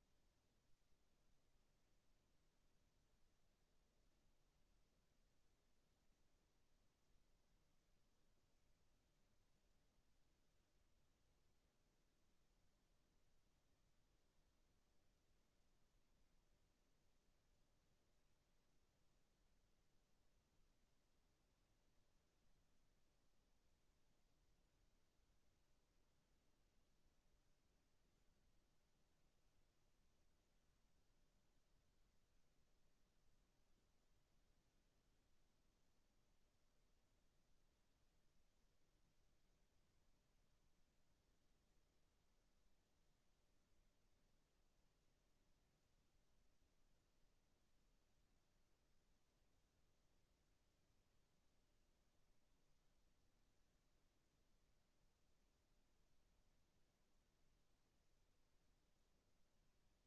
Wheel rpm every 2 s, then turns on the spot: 0, 0, 0, 0, 0, 0, 0, 0, 0, 0, 0, 0, 0, 0, 0, 0, 0, 0, 0, 0, 0, 0, 0, 0, 0, 0, 0, 0, 0, 0.
none